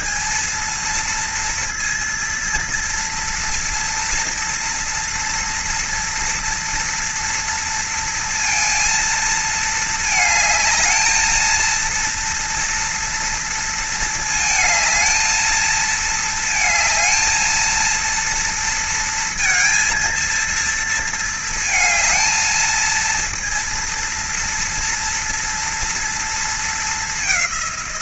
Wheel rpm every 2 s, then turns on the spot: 220, 230, 230, 230, 230, 220, 230, 220, 220, 230, 230, 220, 240, 230.
none